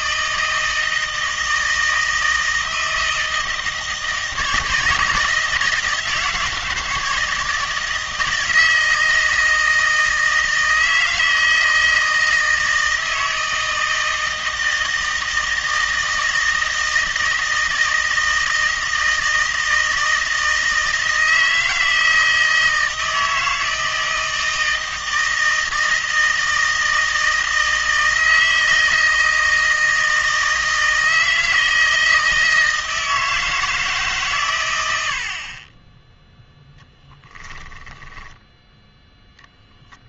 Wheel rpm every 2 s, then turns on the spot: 160, 160, 160, 160, 160, 160, 160, 160, 160, 160, 160, 160, 160, 160, 160, 160, 160, 100, 0, 10.
38-40